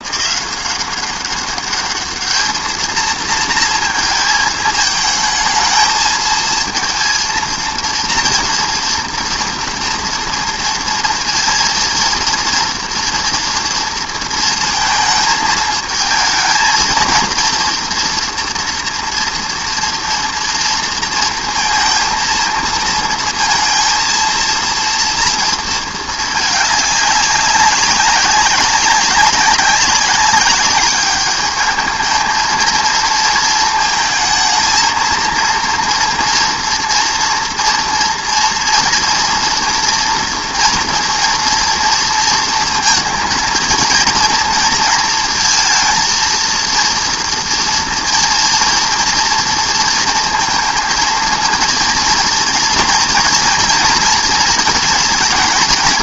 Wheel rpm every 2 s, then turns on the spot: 170, 200, 230, 220, 230, 230, 220, 240, 220, 230, 230, 230, 230, 230, 190, 200, 210, 220, 230, 230, 230, 230, 230, 230, 230, 230, 230, 230.
none